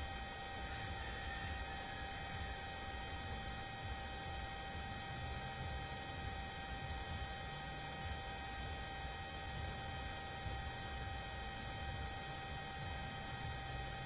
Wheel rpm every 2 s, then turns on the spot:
0, 0, 0, 0, 0, 0, 0.
none